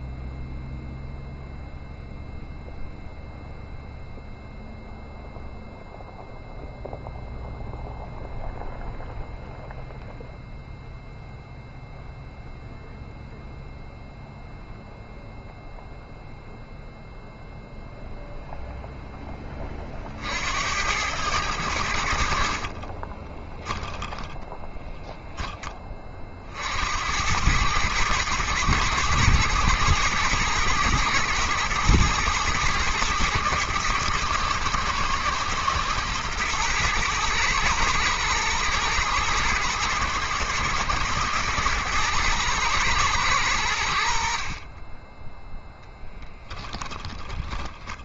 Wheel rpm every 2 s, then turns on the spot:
0, 0, 0, 0, 0, 0, 0, 0, 0, 0, 80, 40, 10, 70, 110, 120, 110, 110, 110, 120, 120, 110, 20, 20.
22-24 46-48